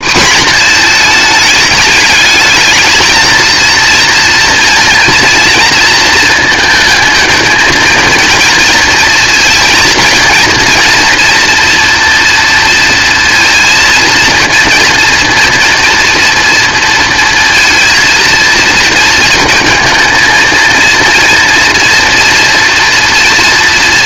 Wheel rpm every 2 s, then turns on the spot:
230, 220, 230, 230, 230, 230, 230, 230, 230, 230, 230, 230.
none